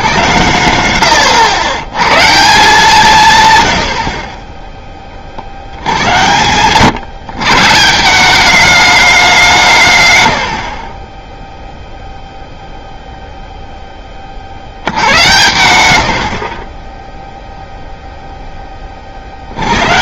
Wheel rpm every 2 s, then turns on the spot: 100, 170, 20, 110, 200, 90, 0, 70, 50, 10.
10-12